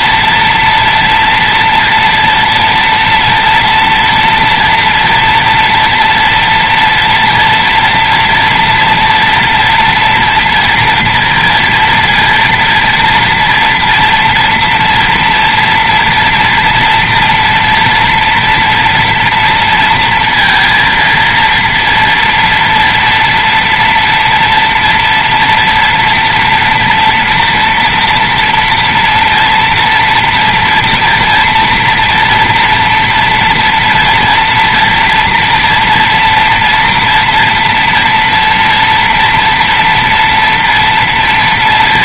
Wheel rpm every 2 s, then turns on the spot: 230, 230, 240, 230, 230, 230, 230, 230, 230, 230, 230, 230, 230, 230, 230, 230, 240, 230, 240, 230, 230.
none